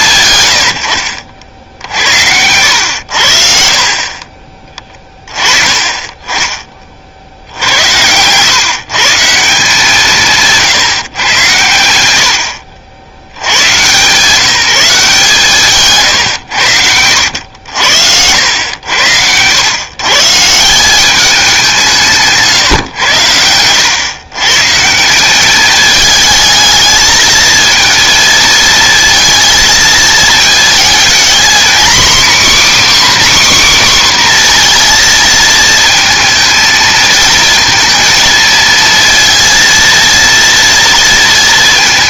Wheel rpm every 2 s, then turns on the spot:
90, 80, 20, 40, 140, 140, 80, 170, 80, 90, 180, 120, 150, 220, 230, 230, 290, 240, 220, 230, 230.
none